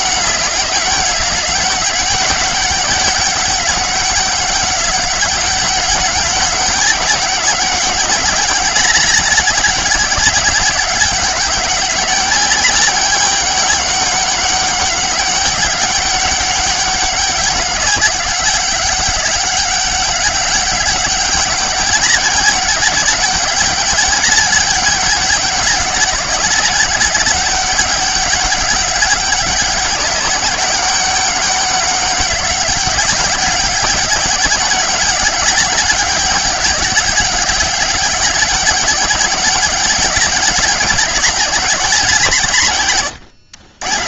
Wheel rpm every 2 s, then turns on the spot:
190, 200, 200, 200, 200, 200, 200, 200, 200, 200, 190, 190, 200, 190, 200, 200, 200, 200, 190, 190, 200, 130.
none